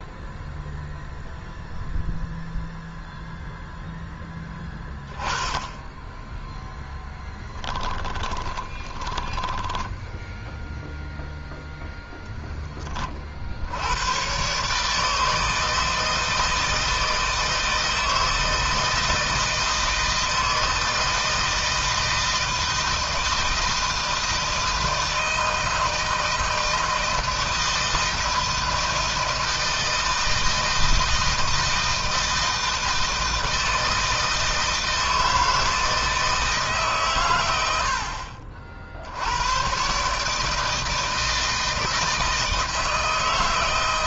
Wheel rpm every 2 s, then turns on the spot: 0, 0, 10, 10, 10, 0, 20, 150, 160, 160, 160, 160, 160, 160, 160, 160, 160, 160, 140, 80, 160, 160.
6-10